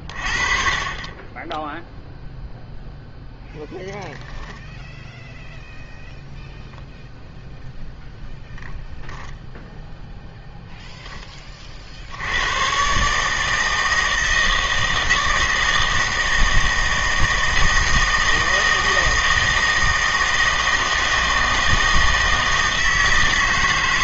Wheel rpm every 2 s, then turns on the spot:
30, 0, 0, 0, 0, 0, 110, 160, 160, 160, 160, 160.
none